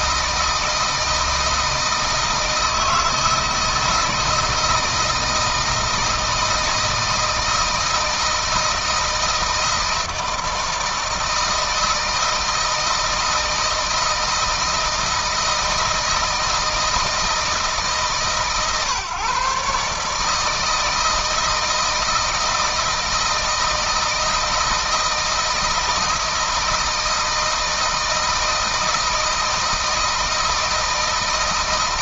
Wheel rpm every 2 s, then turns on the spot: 160, 160, 160, 160, 160, 160, 160, 160, 160, 140, 160, 160, 160, 160, 160, 160.
none